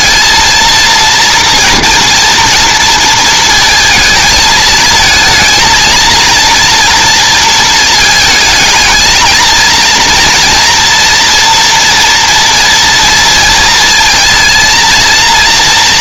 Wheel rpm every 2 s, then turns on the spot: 230, 230, 220, 230, 220, 240, 230, 230.
none